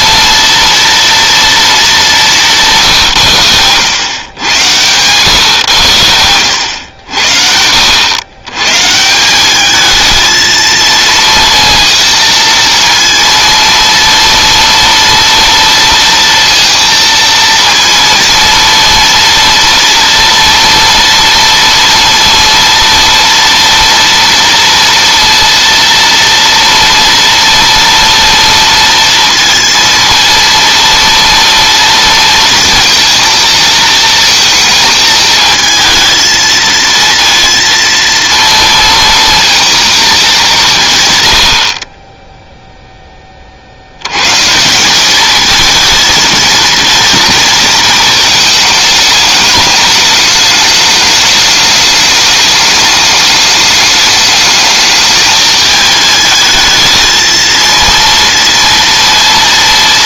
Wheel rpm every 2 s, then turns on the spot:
240, 210, 110, 100, 80, 220, 230, 230, 230, 230, 230, 230, 230, 230, 230, 230, 230, 220, 220, 230, 220, 20, 100, 230, 230, 220, 210, 210, 220, 230.
none